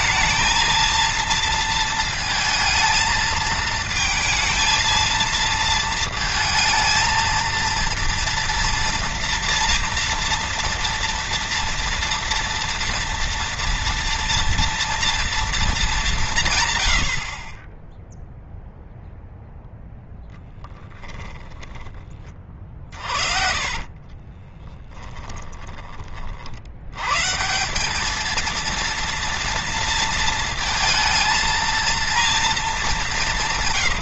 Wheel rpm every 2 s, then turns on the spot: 230, 220, 230, 230, 230, 230, 240, 230, 70, 0, 20, 30, 20, 130, 230, 220, 180.
16-18 20-26